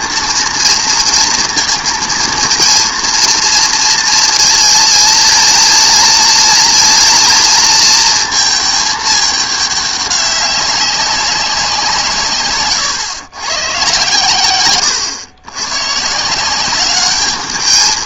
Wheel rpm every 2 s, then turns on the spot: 230, 230, 230, 230, 220, 190, 120, 110, 190.
12-14